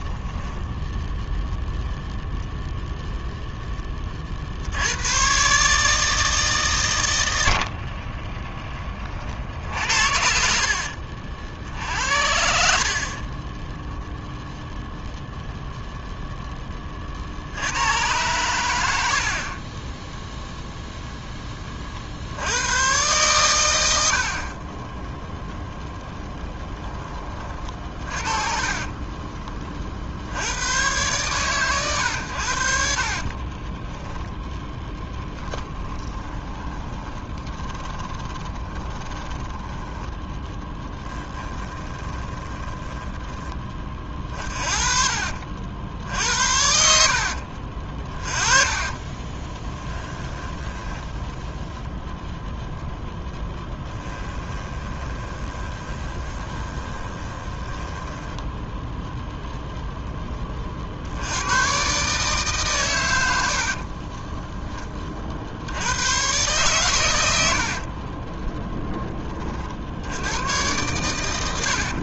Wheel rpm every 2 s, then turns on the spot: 0, 10, 140, 50, 60, 60, 10, 0, 80, 20, 20, 110, 0, 40, 30, 130, 20, 20, 20, 10, 10, 10, 60, 60, 20, 10, 0, 20, 20, 0, 70, 100, 20, 100, 10, 110.
8-10 12-14 32-44 46-52 54-58